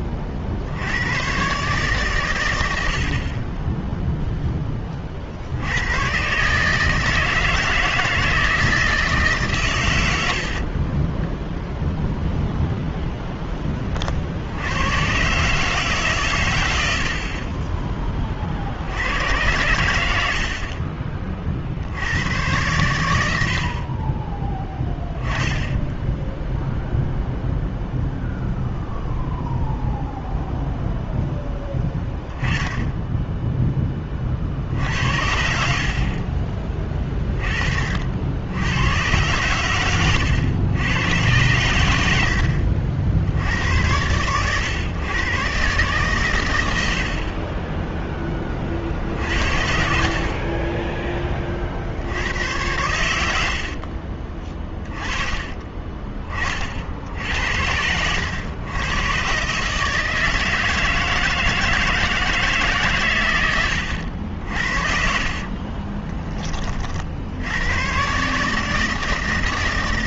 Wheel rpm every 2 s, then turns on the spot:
40, 110, 20, 150, 160, 50, 10, 120, 60, 100, 50, 70, 10, 0, 0, 10, 10, 60, 30, 110, 110, 90, 130, 30, 60, 20, 80, 20, 70, 130, 160, 100, 50, 40, 160.
10-12 64-66